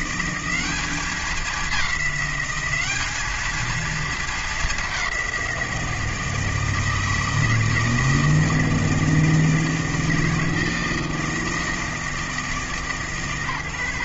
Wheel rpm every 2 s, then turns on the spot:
190, 200, 210, 160, 160, 160, 150.
none